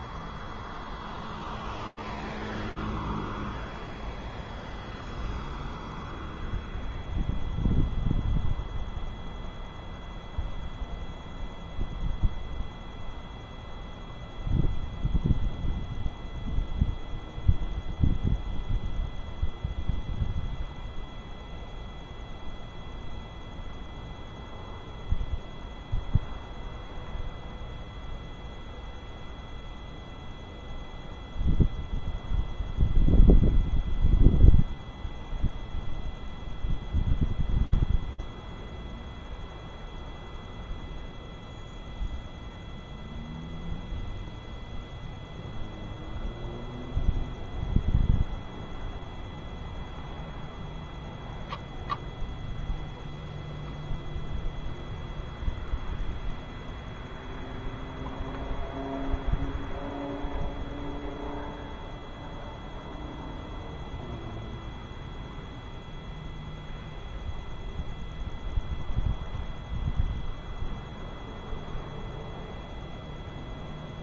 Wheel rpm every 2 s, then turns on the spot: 0, 0, 0, 0, 0, 0, 0, 0, 0, 0, 0, 0, 0, 0, 0, 0, 0, 0, 0, 0, 0, 0, 0, 0, 0, 0, 0, 0, 0, 0, 0, 0, 0, 0, 0, 0, 0.
none